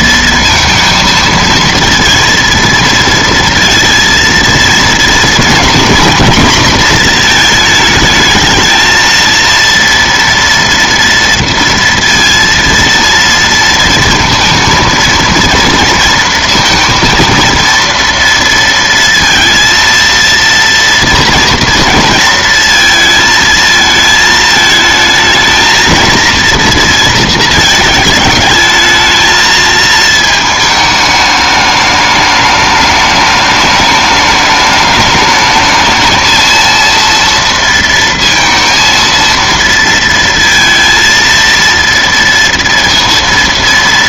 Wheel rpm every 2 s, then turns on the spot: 230, 230, 230, 240, 220, 240, 230, 230, 230, 230, 230, 230, 220, 230, 220, 220, 210, 210, 230, 230, 230, 230.
none